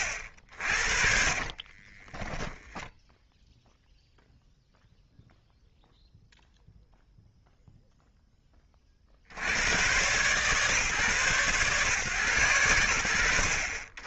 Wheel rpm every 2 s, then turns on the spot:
50, 10, 0, 0, 20, 140, 80.
none